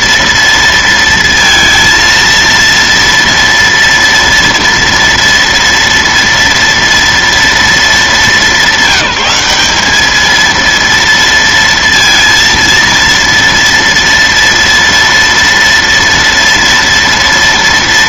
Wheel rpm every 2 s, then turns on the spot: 230, 230, 230, 230, 200, 230, 230, 230, 230.
none